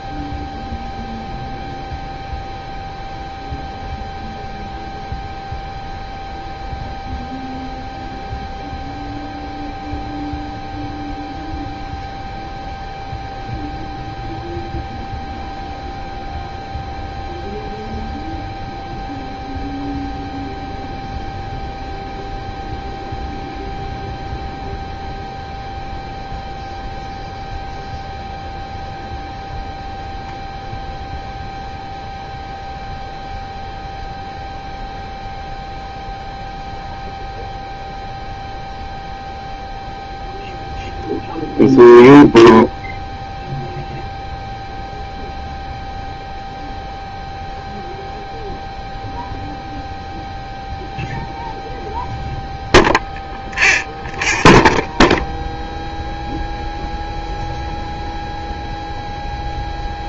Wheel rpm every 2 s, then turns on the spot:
0, 0, 0, 0, 0, 0, 0, 0, 0, 0, 0, 0, 0, 0, 0, 0, 0, 0, 0, 0, 0, 0, 0, 0, 0, 0, 0, 0, 0, 0.
none